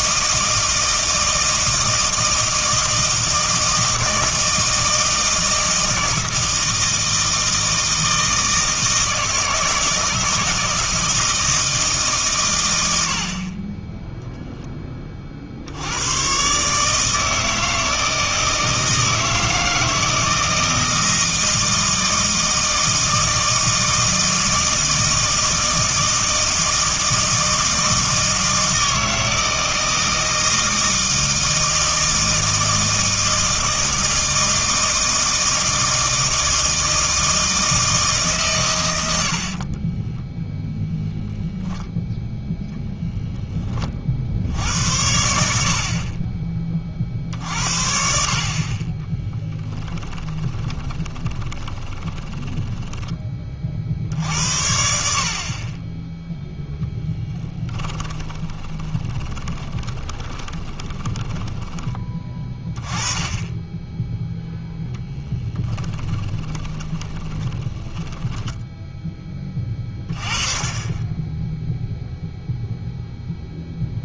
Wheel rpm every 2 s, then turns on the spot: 160, 160, 160, 160, 160, 160, 100, 10, 140, 160, 160, 160, 160, 160, 160, 160, 160, 160, 160, 110, 0, 0, 80, 30, 30, 20, 10, 70, 0, 20, 20, 20, 0, 20, 10, 20, 0.
50-54 58-62 66-70